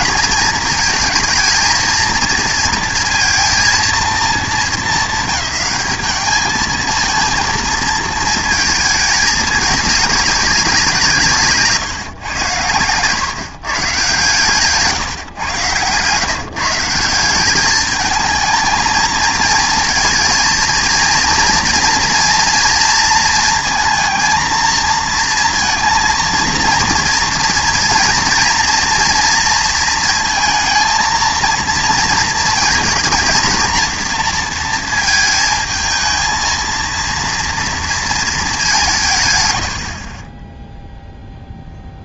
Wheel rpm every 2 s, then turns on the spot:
220, 230, 210, 220, 220, 190, 100, 150, 160, 220, 230, 230, 230, 230, 230, 230, 230, 230, 230, 200, 10.
none